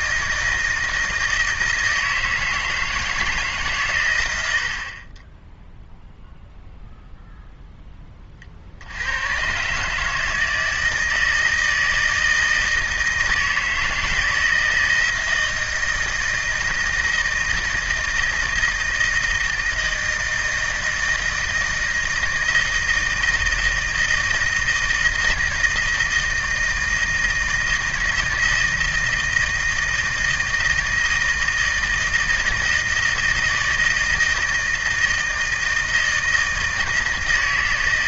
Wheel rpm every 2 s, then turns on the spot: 160, 160, 70, 0, 50, 160, 160, 160, 160, 160, 160, 160, 160, 160, 160, 160, 160, 160, 160.
none